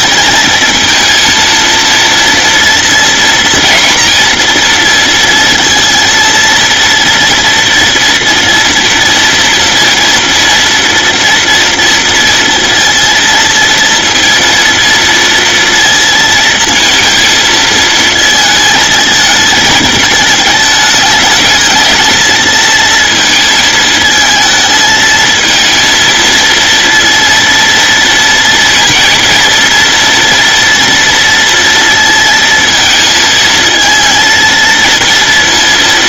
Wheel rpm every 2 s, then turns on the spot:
230, 230, 230, 230, 230, 230, 230, 230, 230, 230, 220, 230, 220, 230, 230, 230, 230, 230.
none